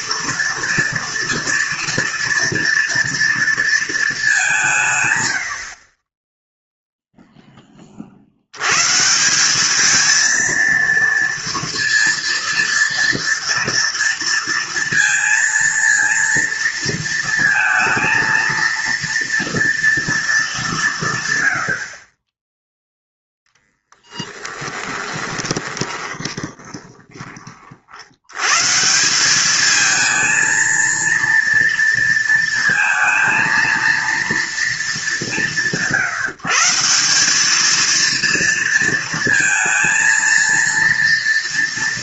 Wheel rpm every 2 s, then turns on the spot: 230, 230, 190, 10, 100, 230, 230, 230, 230, 230, 210, 10, 10, 20, 110, 230, 230, 230, 160, 230, 230.
24-28